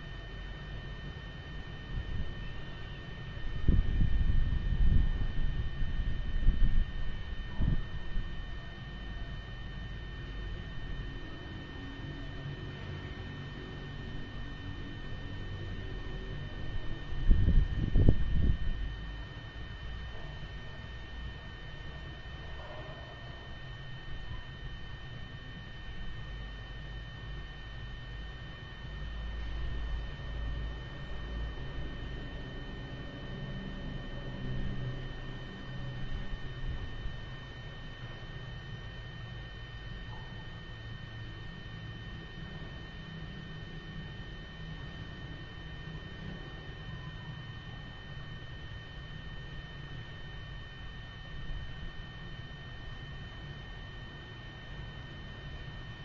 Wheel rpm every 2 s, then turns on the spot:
0, 0, 0, 0, 0, 0, 0, 0, 0, 0, 0, 0, 0, 0, 0, 0, 0, 0, 0, 0, 0, 0, 0, 0, 0, 0, 0, 0.
none